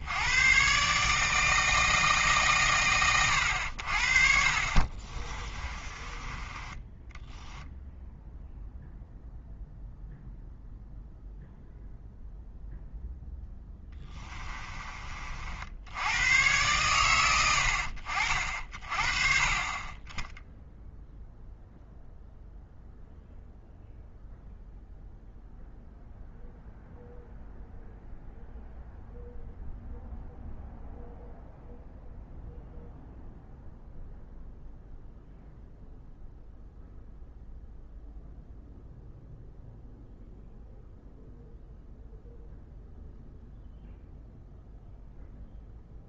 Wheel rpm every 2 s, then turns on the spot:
140, 120, 40, 20, 0, 0, 0, 30, 110, 40, 0, 0, 0, 0, 0, 0, 0, 0, 0, 0, 0, 0, 0.
4-8